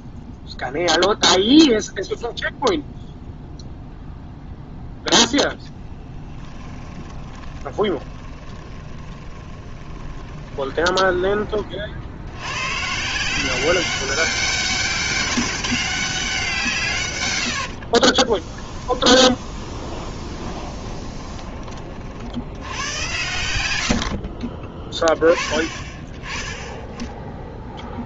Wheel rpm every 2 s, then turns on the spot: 0, 0, 0, 20, 30, 20, 120, 200, 160, 10, 30, 80, 30, 10.
6-12 18-22